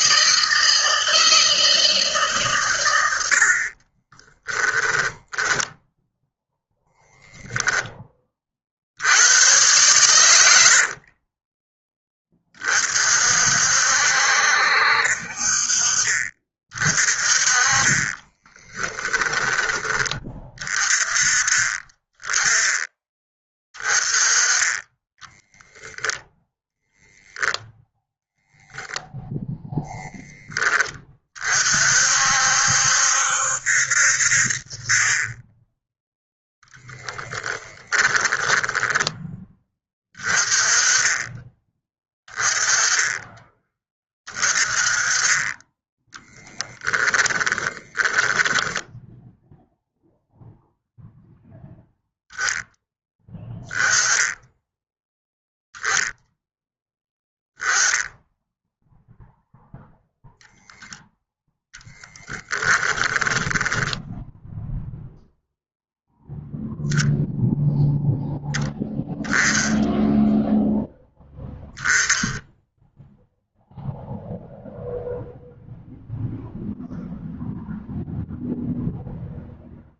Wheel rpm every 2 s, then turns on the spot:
160, 110, 10, 10, 70, 60, 40, 60, 40, 10, 30, 20, 20, 10, 0, 20, 70, 30, 0, 10, 20, 20, 30, 10, 10, 0, 10, 10, 10, 0, 0, 10, 0, 0, 0, 0, 0, 0, 0, 0.
4-6 10-12 18-20 38-40 46-48 62-64